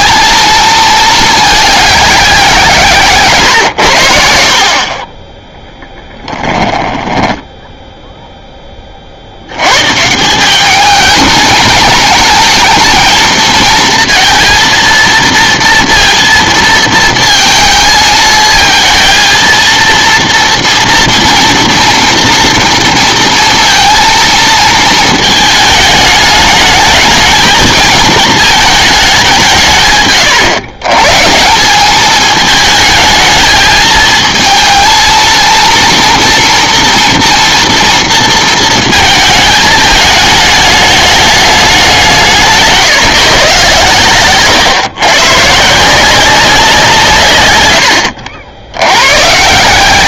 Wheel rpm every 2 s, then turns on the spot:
220, 160, 50, 10, 10, 190, 220, 230, 230, 220, 230, 230, 220, 210, 220, 120, 220, 220, 230, 230, 220, 150, 130, 170, 80.
6-8